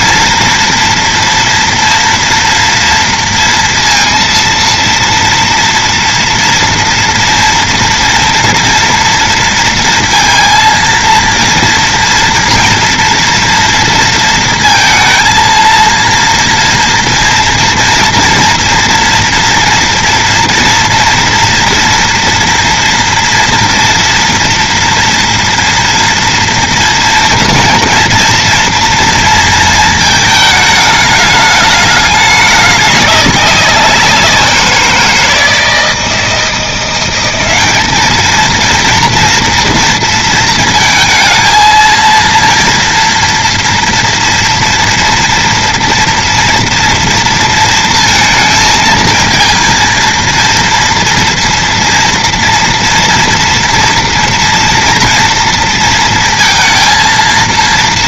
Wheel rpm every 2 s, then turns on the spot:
230, 240, 230, 230, 230, 230, 230, 230, 230, 240, 240, 230, 230, 230, 230, 220, 200, 180, 170, 230, 230, 230, 230, 230, 230, 230, 230, 230, 230.
none